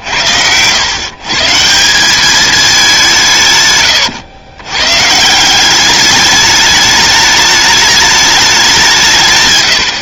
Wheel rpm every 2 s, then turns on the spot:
90, 200, 110, 210, 200.
none